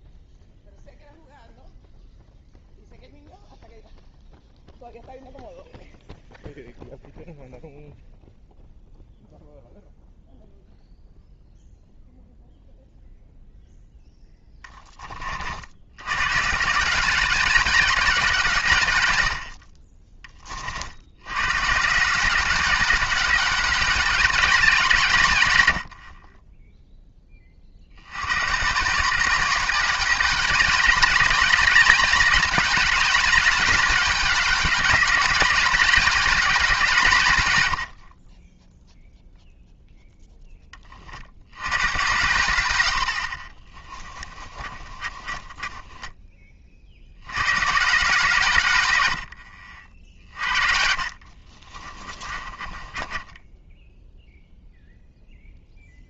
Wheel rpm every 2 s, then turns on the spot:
0, 0, 0, 0, 0, 0, 0, 10, 150, 150, 50, 200, 180, 10, 150, 200, 200, 190, 170, 0, 30, 90, 30, 40, 110, 50, 20, 0.
44-46 50-54